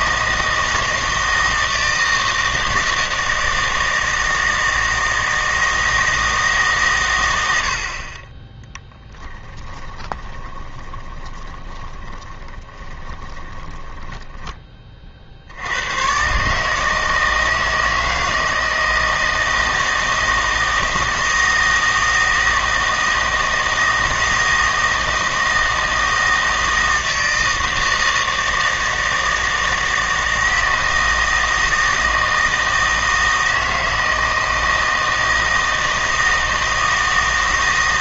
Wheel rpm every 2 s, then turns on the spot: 160, 160, 160, 140, 10, 20, 20, 20, 150, 160, 160, 160, 160, 160, 160, 160, 160, 160, 160.
8-14